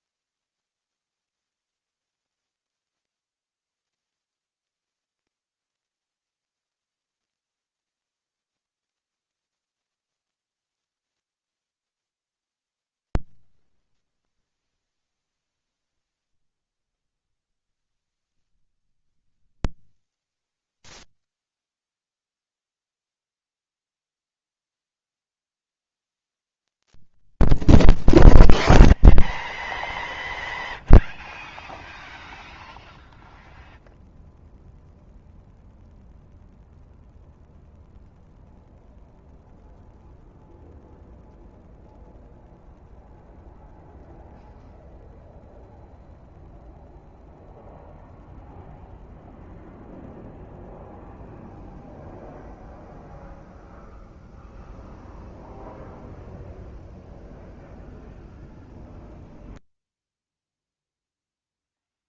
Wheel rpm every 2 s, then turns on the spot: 0, 0, 0, 0, 0, 0, 0, 0, 0, 0, 0, 0, 0, 0, 0, 0, 0, 0, 0, 0, 0, 0, 0, 0, 0, 0, 0, 0, 0, 0, 0.
none